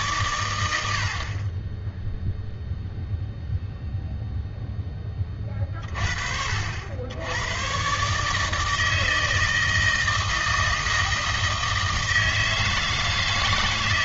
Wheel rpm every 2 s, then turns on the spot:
90, 0, 10, 70, 160, 160, 160.
none